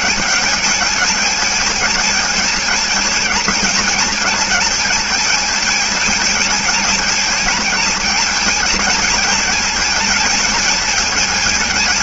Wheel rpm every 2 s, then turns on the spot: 220, 220, 220, 220, 220, 220.
none